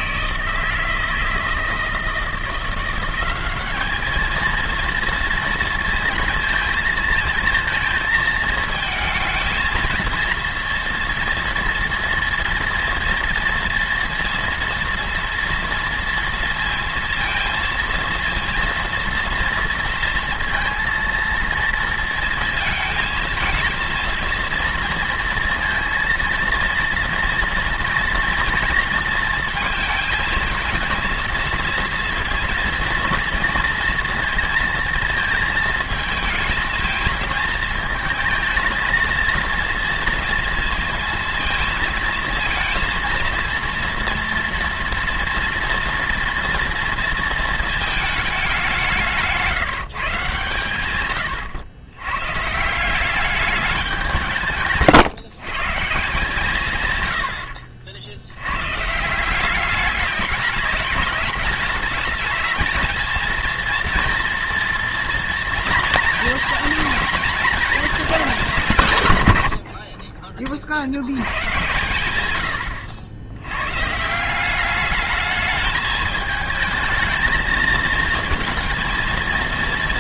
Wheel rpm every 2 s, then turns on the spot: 160, 180, 230, 220, 220, 240, 230, 230, 230, 230, 230, 220, 230, 230, 230, 220, 230, 230, 220, 230, 230, 230, 230, 230, 180, 130, 170, 150, 120, 140, 200, 230, 240, 230, 150, 70, 90, 210, 220, 230.
54-56